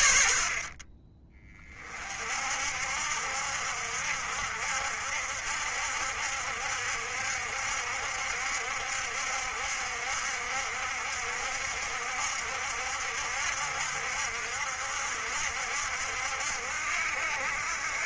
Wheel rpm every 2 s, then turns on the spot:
40, 60, 60, 70, 70, 60, 70, 60, 60.
none